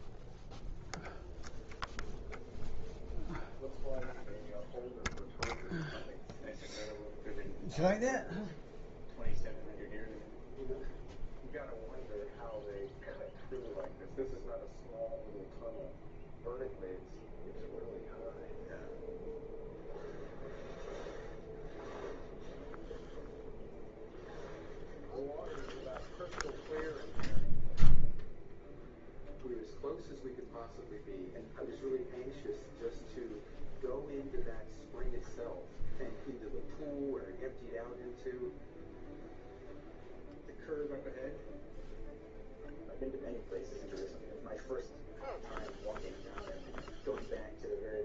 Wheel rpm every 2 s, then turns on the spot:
0, 0, 0, 0, 0, 0, 0, 0, 0, 0, 0, 0, 0, 0, 0, 0, 0, 0, 0, 0, 0, 0, 0, 0.
none